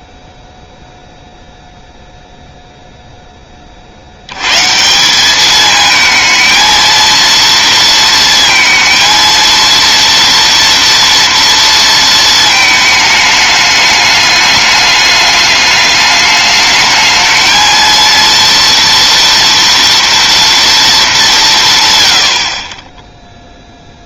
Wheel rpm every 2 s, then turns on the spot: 0, 20, 200, 230, 230, 230, 210, 210, 220, 240, 180, 0.
none